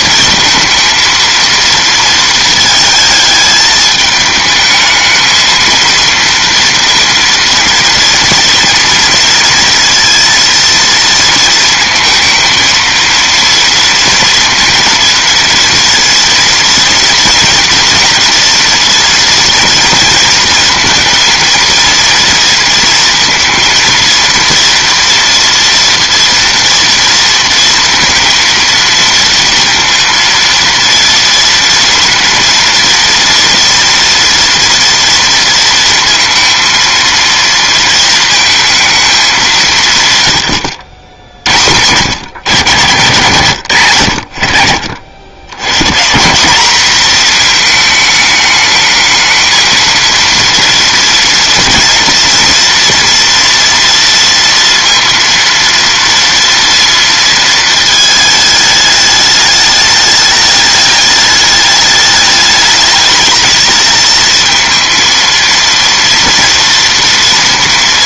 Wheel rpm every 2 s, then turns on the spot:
230, 220, 220, 230, 230, 230, 230, 230, 230, 230, 230, 230, 230, 240, 230, 230, 230, 230, 230, 220, 110, 120, 60, 200, 220, 230, 230, 230, 230, 210, 210, 210, 220, 230.
none